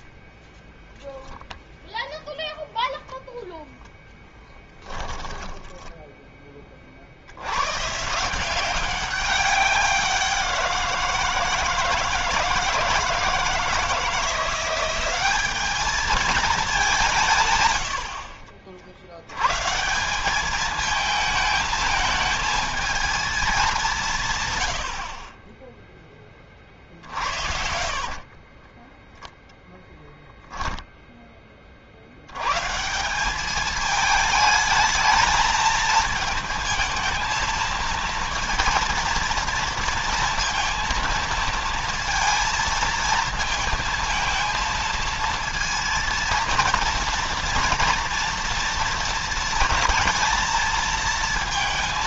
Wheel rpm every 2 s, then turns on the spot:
10, 0, 10, 20, 170, 180, 170, 180, 210, 60, 200, 220, 120, 30, 20, 10, 130, 220, 220, 230, 230, 230, 230, 230, 230, 220.
4-6 28-30